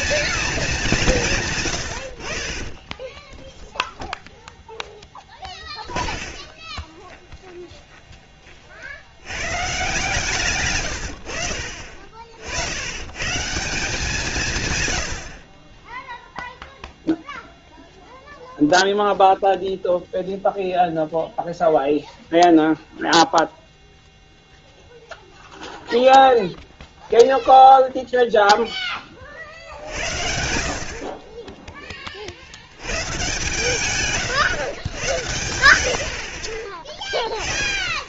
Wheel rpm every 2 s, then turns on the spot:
180, 10, 10, 30, 60, 100, 90, 110, 0, 0, 0, 0, 0, 0, 20, 40, 100, 120, 20.
2-8